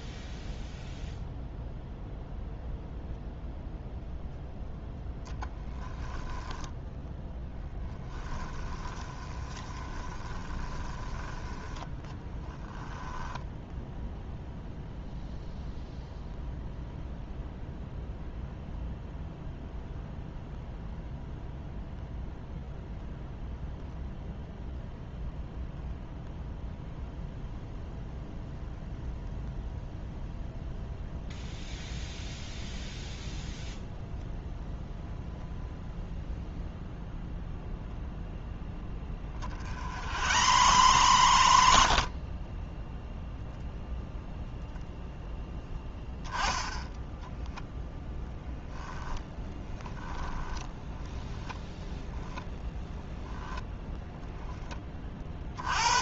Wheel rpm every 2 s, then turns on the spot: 0, 0, 0, 10, 10, 20, 10, 0, 0, 0, 0, 0, 0, 0, 0, 0, 0, 0, 0, 0, 80, 30, 0, 10, 0, 10, 10, 10.
6-14 40-42 50-54